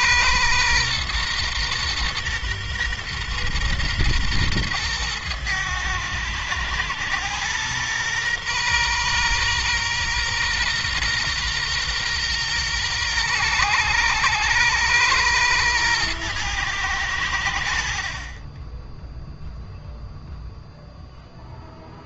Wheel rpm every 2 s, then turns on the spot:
120, 120, 120, 110, 120, 120, 120, 110, 110, 20, 0.
none